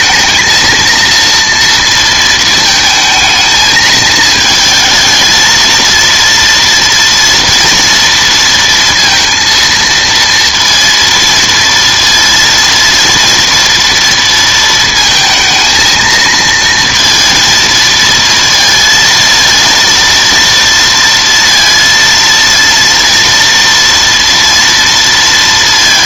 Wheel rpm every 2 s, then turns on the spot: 230, 220, 220, 230, 230, 230, 230, 220, 230, 230, 230, 230, 230.
none